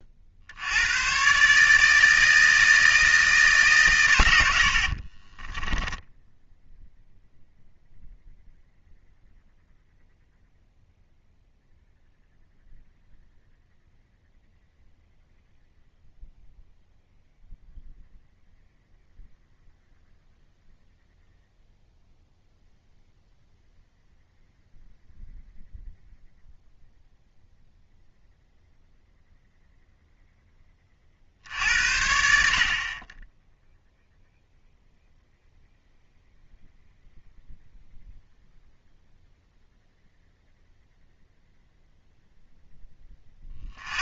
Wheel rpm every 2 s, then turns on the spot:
80, 160, 60, 0, 0, 0, 0, 0, 0, 0, 0, 0, 0, 0, 0, 10, 60, 0, 0, 0, 0, 10.
none